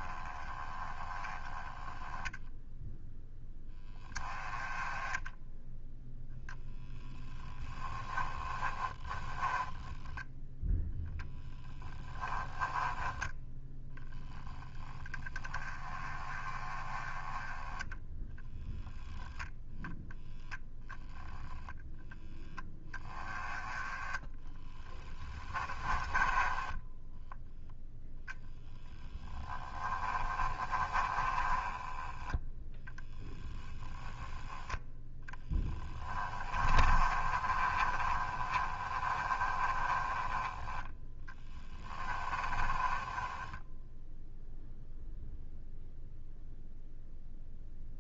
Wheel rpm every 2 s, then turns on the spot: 20, 0, 10, 0, 10, 0, 10, 10, 20, 10, 0, 10, 20, 10, 10, 20, 10, 10, 30, 20, 10, 20, 0, 0.
8-10 24-26 30-34 36-40 42-44